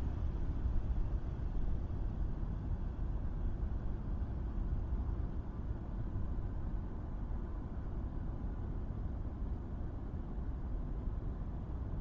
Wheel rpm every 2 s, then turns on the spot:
0, 0, 0, 0, 0, 0.
none